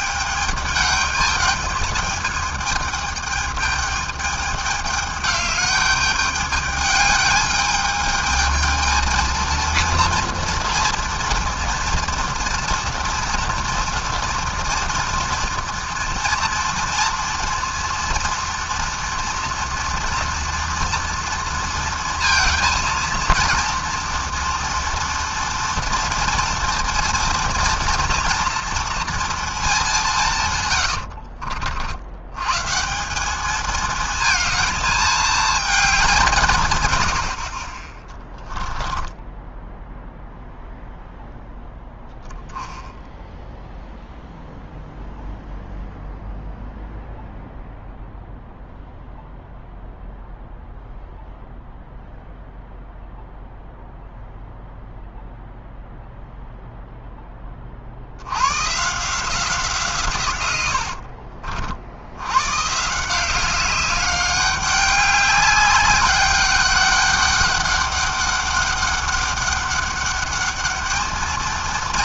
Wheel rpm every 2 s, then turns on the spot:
210, 220, 210, 210, 230, 230, 230, 230, 230, 230, 230, 230, 230, 230, 230, 70, 200, 220, 80, 10, 0, 0, 0, 0, 0, 0, 0, 0, 10, 170, 50, 180, 200, 200, 200, 220.
30-32 38-40 60-62